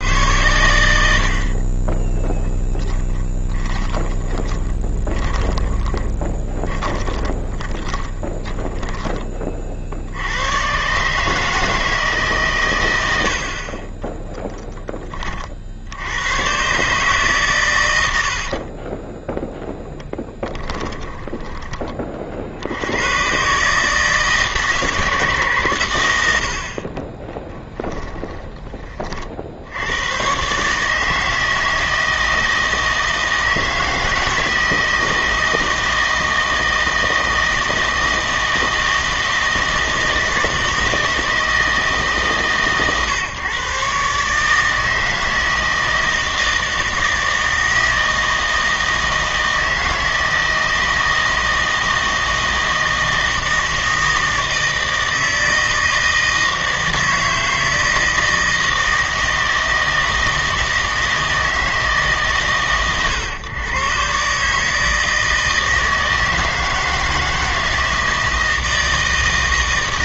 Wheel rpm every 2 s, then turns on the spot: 100, 10, 20, 30, 10, 110, 130, 0, 120, 50, 10, 60, 160, 70, 20, 140, 160, 160, 160, 160, 160, 140, 150, 160, 160, 160, 160, 160, 160, 160, 160, 130, 150, 160, 160.
4-10 18-22